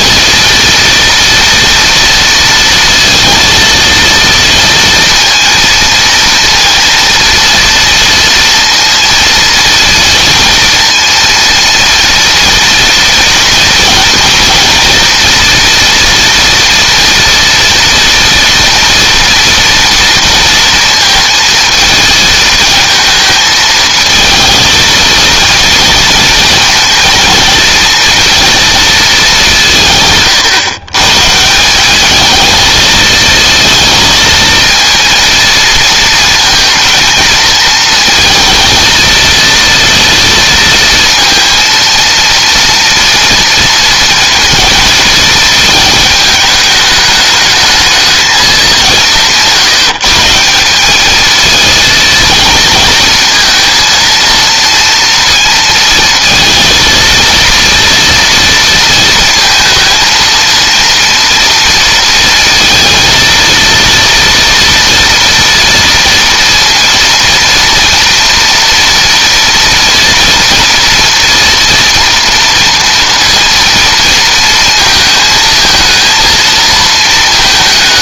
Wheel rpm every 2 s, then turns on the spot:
230, 230, 230, 230, 230, 230, 230, 240, 240, 230, 230, 220, 230, 230, 230, 130, 220, 230, 230, 230, 230, 230, 220, 210, 190, 190, 220, 230, 230, 230, 230, 230, 230, 230, 240, 230, 230, 220, 230.
none